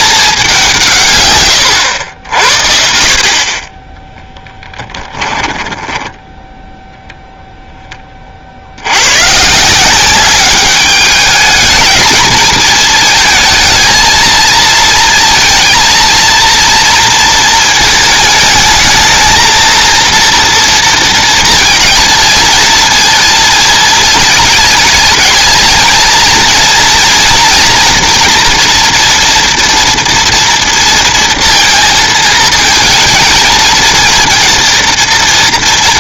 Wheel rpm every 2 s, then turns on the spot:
190, 70, 10, 0, 60, 200, 220, 220, 230, 220, 230, 230, 220, 230, 230, 230, 230, 230.
4-6